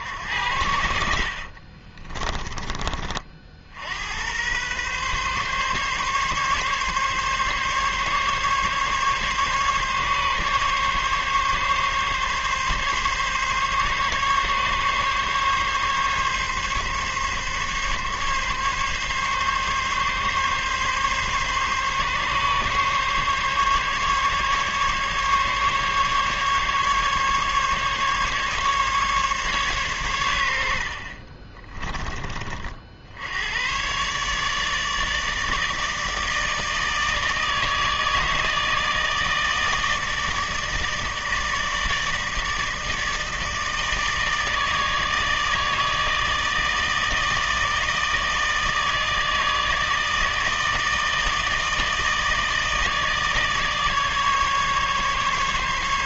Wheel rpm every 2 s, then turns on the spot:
70, 30, 130, 140, 140, 140, 140, 140, 140, 140, 140, 140, 140, 140, 140, 60, 60, 150, 160, 160, 160, 160, 150, 160, 160, 160, 150, 140.
none